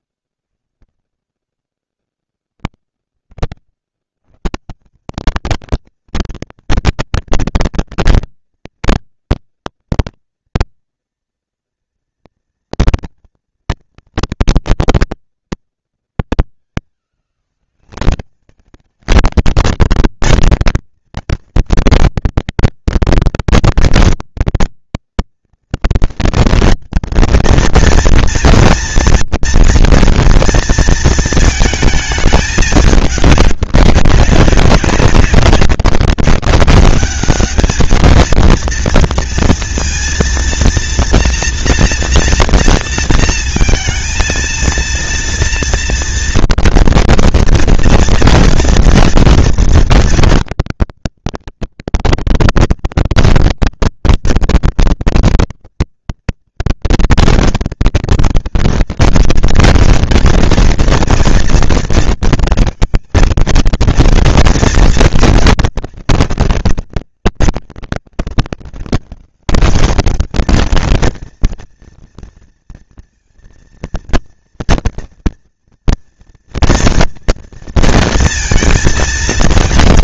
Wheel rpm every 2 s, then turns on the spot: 60, 10, 100, 230, 230, 240, 230, 230, 210, 210, 220, 230, 230, 230, 240, 230, 210, 190, 190, 220, 230, 230, 220, 230, 230, 230, 230, 230, 230, 230, 230, 230, 230, 200, 190, 220, 230, 230, 230, 230.
2-4